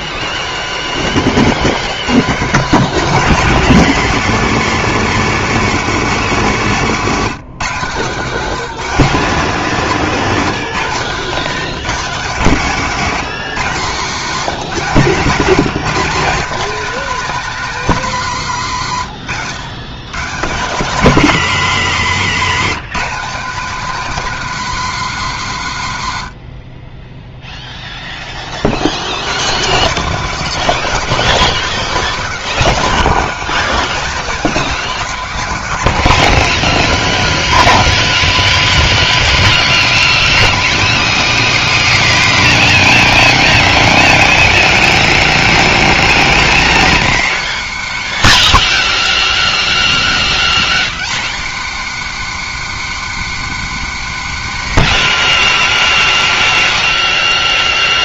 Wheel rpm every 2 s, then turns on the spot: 90, 150, 210, 210, 190, 160, 170, 180, 220, 180, 180, 190, 240, 60, 40, 230, 230, 250, 190, 180, 160, 130, 100, 120, 110, 100, 140, 150, 100.
none